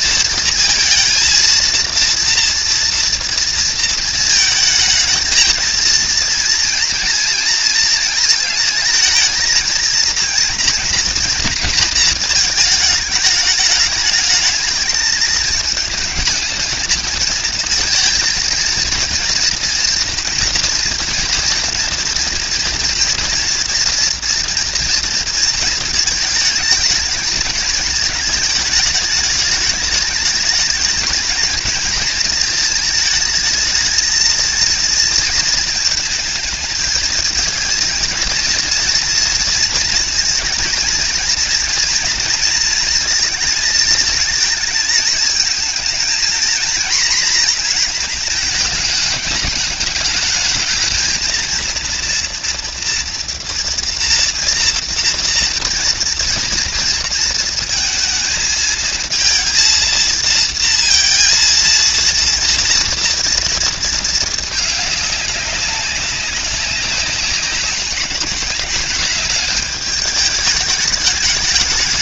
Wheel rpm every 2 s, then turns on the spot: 230, 230, 220, 230, 230, 230, 220, 220, 220, 230, 240, 240, 230, 220, 210, 210, 220, 230, 220, 230, 230, 230, 220, 240, 210, 220, 230, 230, 230, 220, 230, 230, 210, 190, 210, 210.
none